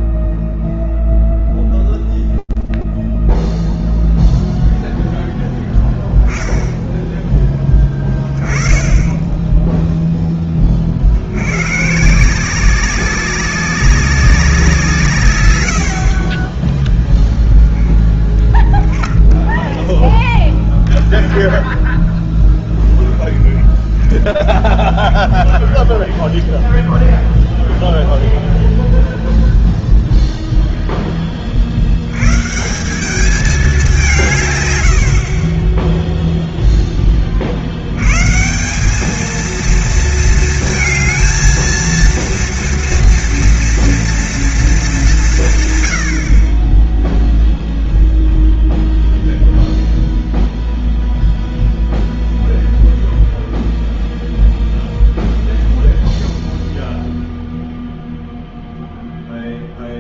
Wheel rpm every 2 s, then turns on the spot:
0, 0, 0, 10, 10, 30, 190, 170, 10, 0, 0, 0, 0, 0, 0, 10, 190, 80, 20, 210, 230, 230, 190, 0, 0, 0, 0, 0, 0, 0.
none